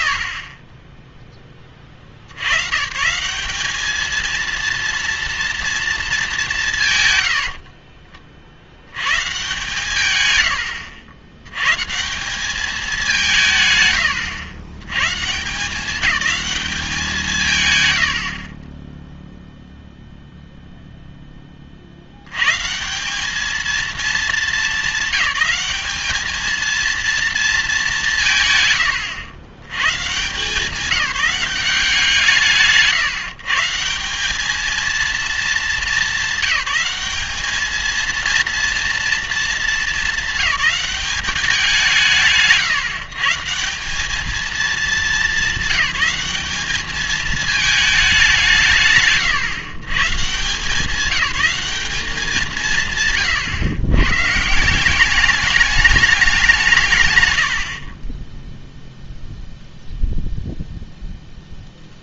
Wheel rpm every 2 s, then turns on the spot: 70, 120, 230, 170, 70, 100, 210, 110, 200, 30, 0, 150, 210, 230, 140, 180, 150, 220, 200, 230, 210, 150, 220, 210, 150, 170, 160, 170, 160, 0, 0.
0-2